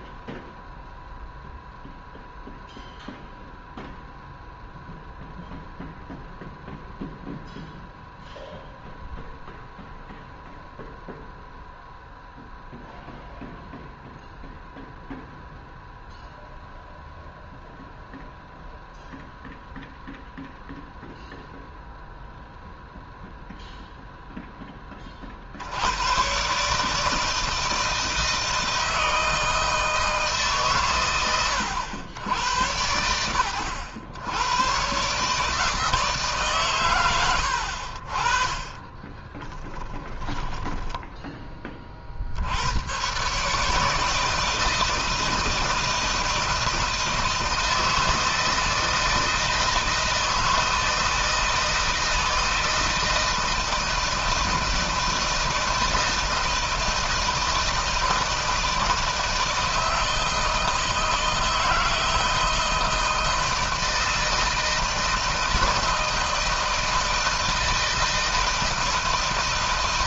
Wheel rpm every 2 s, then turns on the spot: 0, 0, 0, 0, 0, 0, 0, 0, 0, 0, 0, 0, 20, 150, 160, 120, 90, 120, 120, 30, 10, 100, 160, 160, 160, 160, 160, 160, 160, 160, 160, 160, 160, 160, 160.
38-42